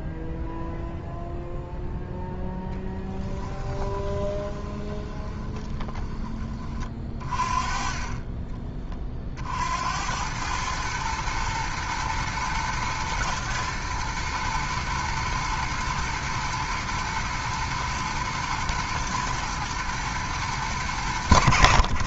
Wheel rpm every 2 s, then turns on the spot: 0, 0, 20, 30, 30, 110, 110, 110, 110, 110, 100.
4-6